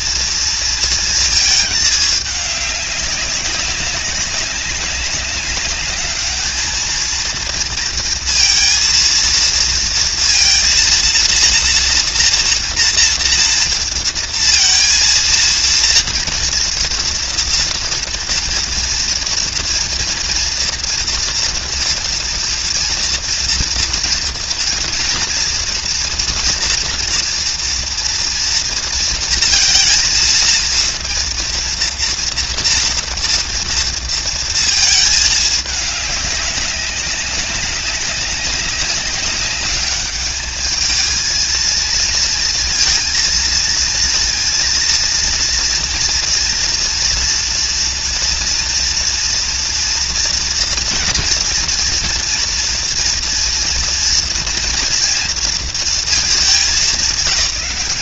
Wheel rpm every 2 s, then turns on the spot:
240, 220, 200, 200, 230, 230, 240, 230, 230, 230, 230, 230, 240, 240, 240, 220, 230, 230, 210, 200, 200, 230, 230, 230, 230, 230, 230, 230, 220.
none